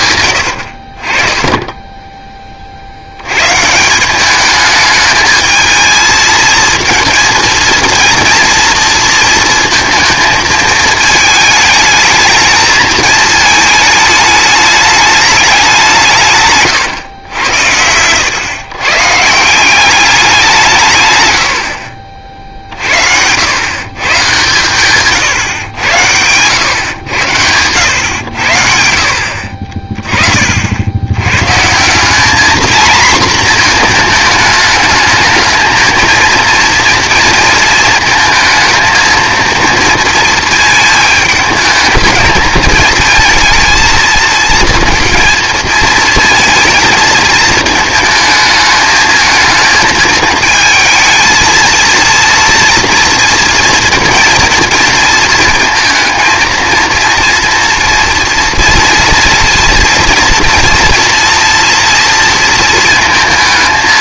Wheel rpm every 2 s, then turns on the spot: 80, 40, 210, 230, 230, 220, 220, 210, 140, 120, 160, 60, 130, 110, 70, 60, 230, 210, 230, 220, 220, 220, 230, 220, 220, 220, 230, 230, 230, 230, 230, 230.
0-2